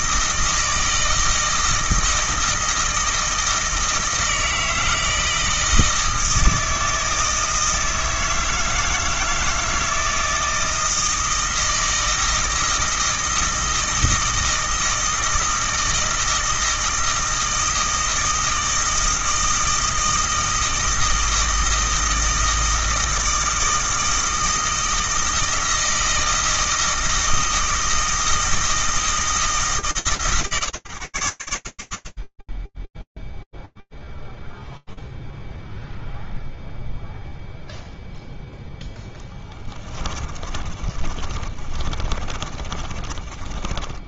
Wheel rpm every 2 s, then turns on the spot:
160, 160, 160, 160, 160, 160, 160, 160, 160, 160, 160, 160, 160, 160, 160, 110, 0, 0, 0, 10, 30, 20.
40-44